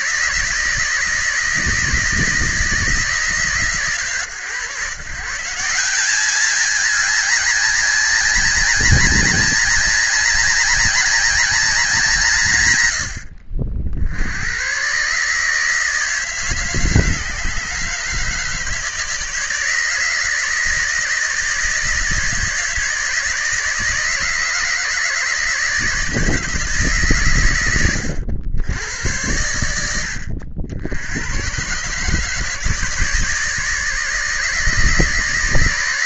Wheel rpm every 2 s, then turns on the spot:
160, 160, 140, 190, 190, 200, 160, 80, 160, 150, 160, 160, 150, 160, 90, 80, 150, 150.
none